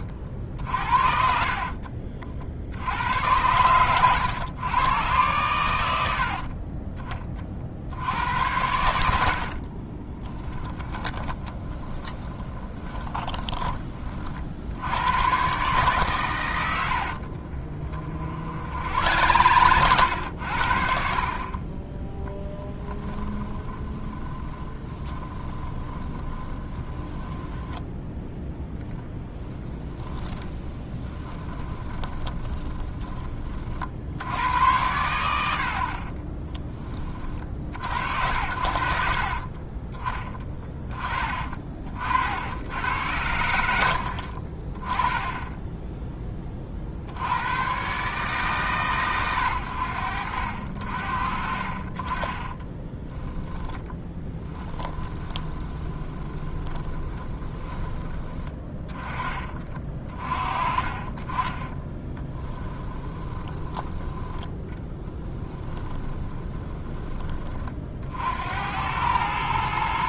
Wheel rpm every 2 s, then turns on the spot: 60, 70, 110, 30, 80, 10, 20, 80, 80, 60, 60, 10, 30, 20, 10, 20, 20, 90, 20, 70, 30, 80, 40, 40, 130, 60, 20, 10, 20, 20, 30, 10, 10, 20, 90.
0-2 8-14 16-20 22-28 30-34 52-58 62-68